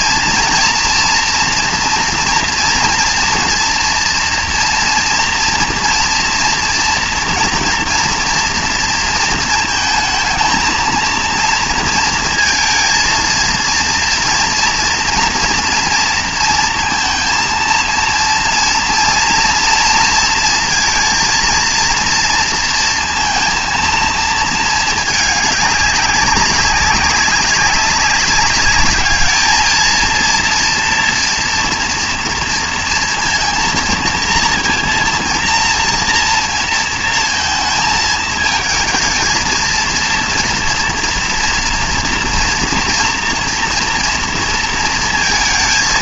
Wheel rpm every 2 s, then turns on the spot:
240, 240, 230, 230, 230, 230, 230, 230, 230, 230, 230, 230, 220, 190, 200, 230, 230, 230, 230, 220, 230, 230, 230.
none